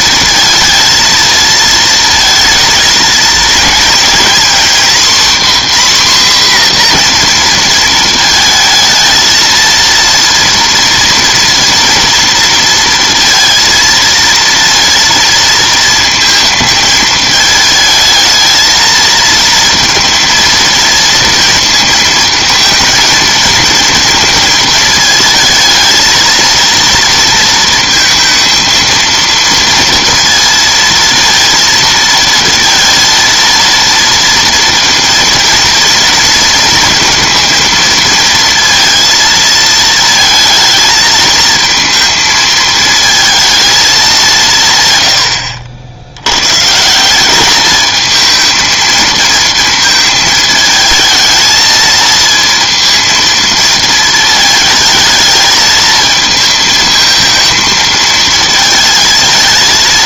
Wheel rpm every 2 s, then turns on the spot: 230, 220, 250, 250, 220, 230, 230, 230, 220, 220, 230, 220, 220, 230, 230, 230, 230, 230, 230, 230, 230, 220, 140, 150, 220, 220, 230, 220, 220, 220.
none